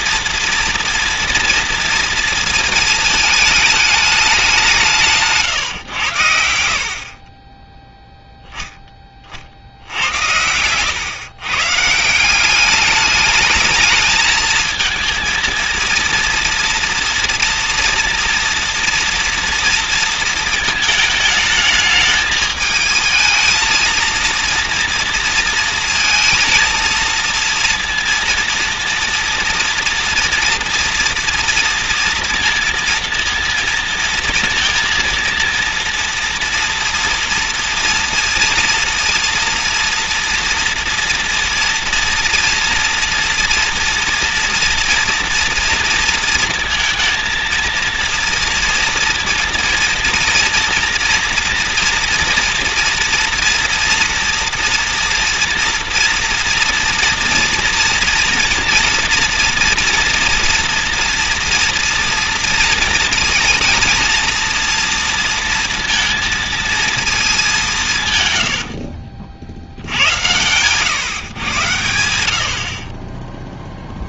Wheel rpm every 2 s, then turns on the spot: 230, 230, 190, 70, 10, 100, 190, 220, 230, 230, 220, 220, 240, 230, 230, 230, 230, 230, 230, 230, 240, 230, 240, 230, 230, 230, 240, 240, 240, 230, 230, 230, 230, 230, 90, 110, 70.
68-70